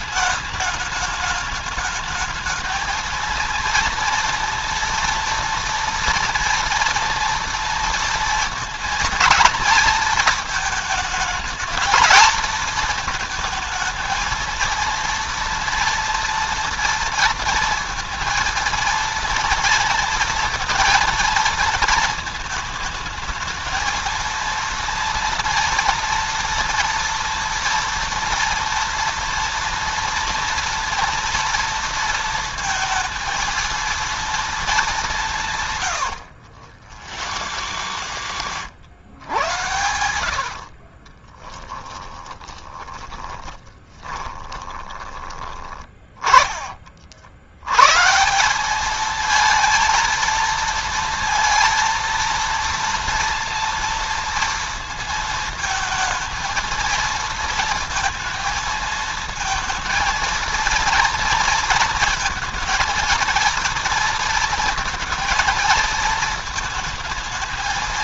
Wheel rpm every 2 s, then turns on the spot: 210, 220, 230, 230, 230, 220, 220, 230, 230, 230, 230, 220, 230, 230, 230, 230, 220, 220, 80, 110, 60, 10, 20, 30, 180, 230, 230, 230, 230, 230, 230, 230, 230, 220.
36-38 40-46